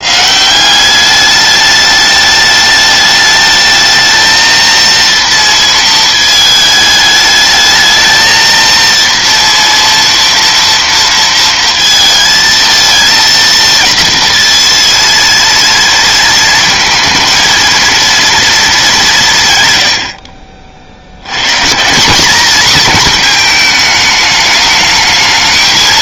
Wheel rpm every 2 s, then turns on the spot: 170, 210, 220, 220, 230, 230, 220, 230, 230, 220, 50, 220, 210.
none